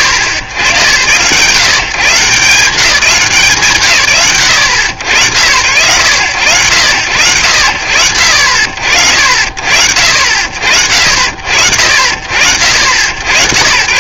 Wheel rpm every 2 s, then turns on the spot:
100, 170, 90, 100, 60, 50, 60.
none